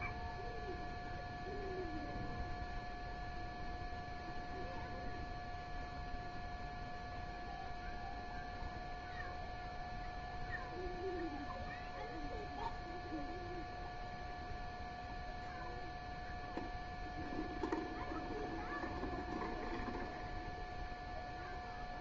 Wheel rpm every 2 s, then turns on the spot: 0, 0, 0, 0, 0, 0, 0, 0, 0, 0, 0.
none